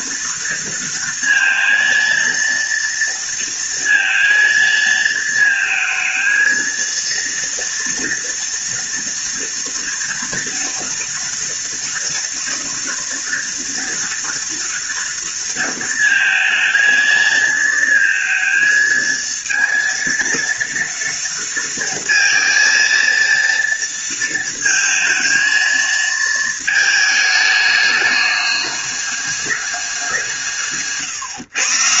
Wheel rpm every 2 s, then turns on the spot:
230, 230, 230, 220, 230, 230, 230, 230, 220, 220, 230, 230, 230, 220, 210, 170.
none